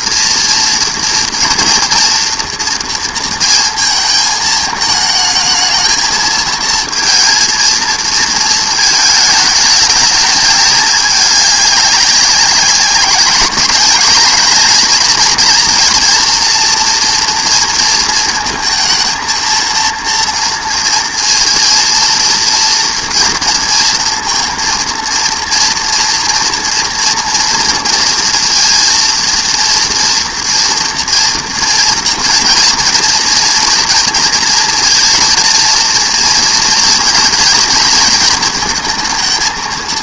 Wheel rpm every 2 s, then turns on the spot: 230, 230, 220, 230, 220, 210, 190, 220, 230, 220, 230, 230, 230, 230, 230, 240, 240, 230, 230, 220.
none